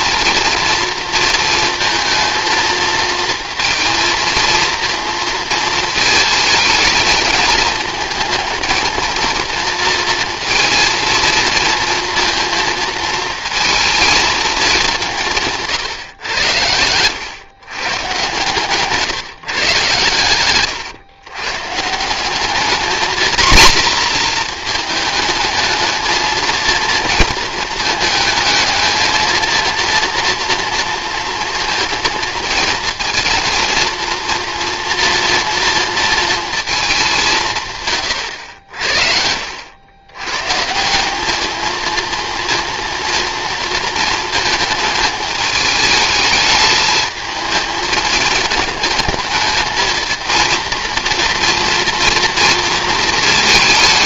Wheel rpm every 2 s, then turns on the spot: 230, 230, 230, 210, 230, 230, 230, 200, 100, 140, 120, 230, 220, 230, 220, 230, 230, 240, 220, 70, 190, 230, 220, 220, 210, 230, 230.
38-40